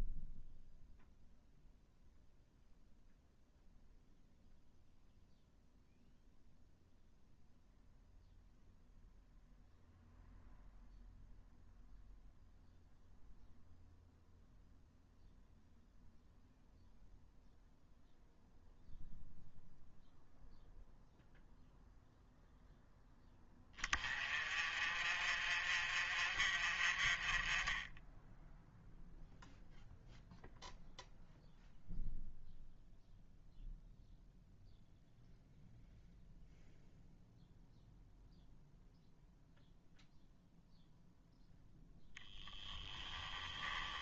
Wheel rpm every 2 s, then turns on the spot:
0, 0, 0, 0, 0, 0, 0, 0, 0, 0, 0, 0, 30, 40, 0, 0, 0, 0, 0, 0, 0, 10.
42-44